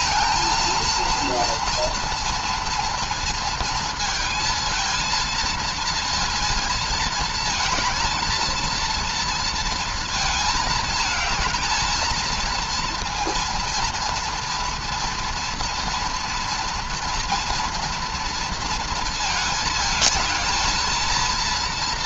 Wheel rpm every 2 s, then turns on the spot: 230, 230, 230, 230, 230, 220, 230, 230, 240, 230, 230.
none